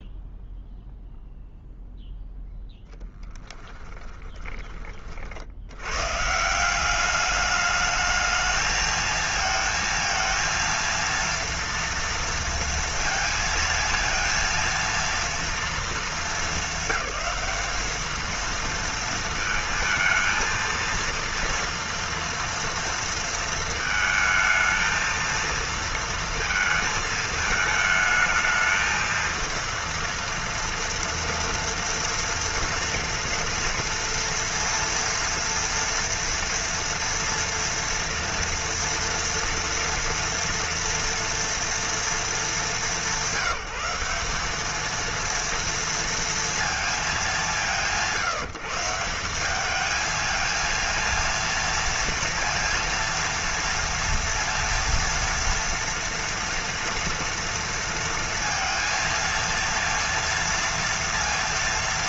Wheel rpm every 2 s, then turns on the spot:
0, 0, 30, 190, 220, 230, 230, 230, 210, 220, 230, 230, 230, 230, 220, 230, 230, 230, 240, 230, 230, 200, 210, 230, 170, 230, 230, 230, 230, 230, 230.
none